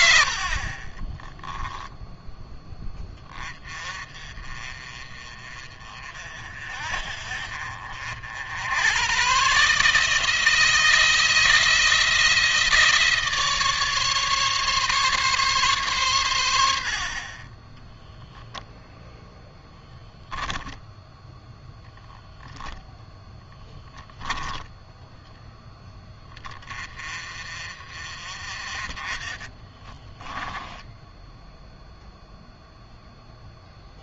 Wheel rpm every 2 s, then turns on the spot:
60, 10, 30, 50, 90, 160, 160, 140, 90, 0, 10, 10, 0, 40, 40, 10, 0.
0-2 22-24 30-32